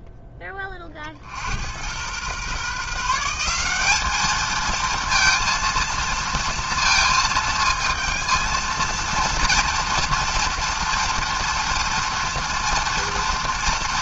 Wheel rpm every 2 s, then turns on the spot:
30, 140, 220, 230, 230, 230, 230.
none